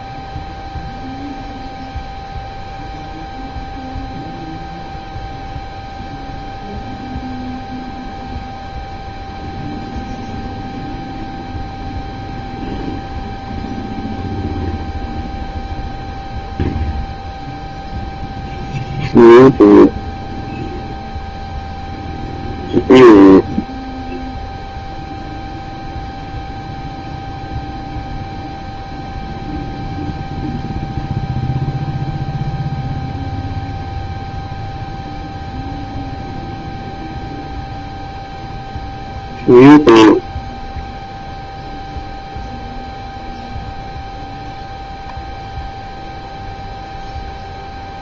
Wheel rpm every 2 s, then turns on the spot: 0, 0, 0, 0, 0, 0, 0, 0, 0, 0, 0, 0, 0, 0, 0, 0, 0, 0, 0, 0, 0, 0, 0, 0.
none